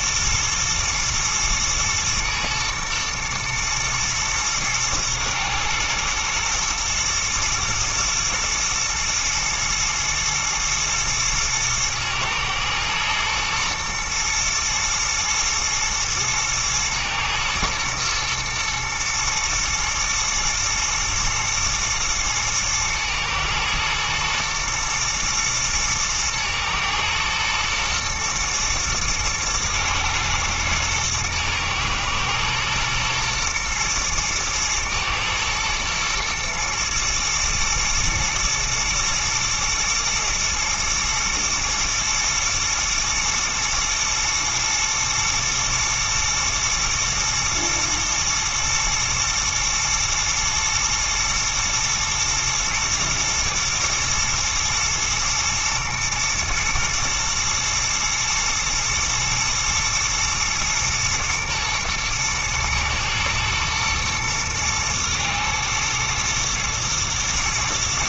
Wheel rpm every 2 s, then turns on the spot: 110, 120, 110, 110, 120, 110, 110, 120, 120, 110, 110, 110, 120, 110, 110, 110, 120, 110, 120, 120, 110, 110, 110, 110, 120, 120, 120, 110, 110, 120, 120, 110, 120, 120.
none